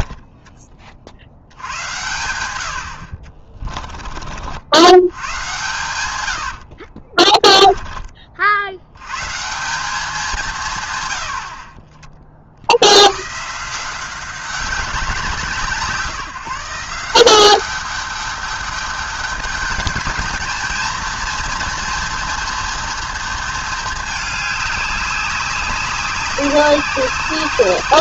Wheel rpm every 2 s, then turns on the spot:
20, 90, 70, 70, 70, 150, 70, 190, 170, 210, 230, 230, 200, 190.
6-8